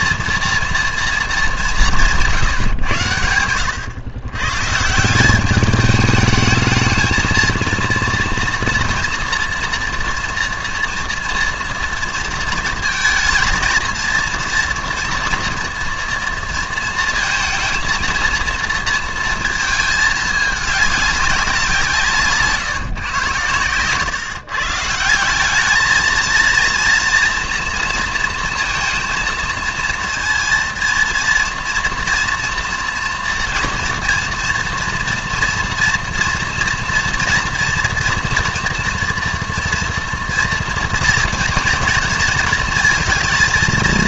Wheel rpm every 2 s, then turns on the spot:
230, 140, 140, 220, 230, 230, 230, 230, 230, 230, 210, 150, 150, 230, 230, 230, 230, 230, 230, 230, 240, 220.
none